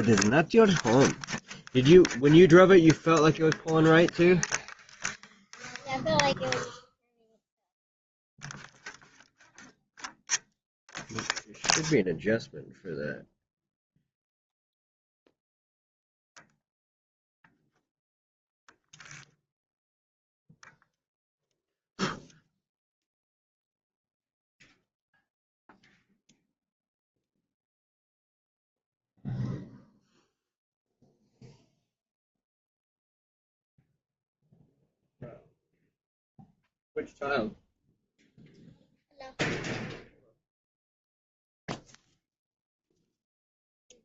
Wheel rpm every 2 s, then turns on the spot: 0, 0, 0, 0, 0, 0, 0, 0, 0, 0, 0, 0, 0, 0, 0, 0, 0, 0, 0, 0, 0, 0.
none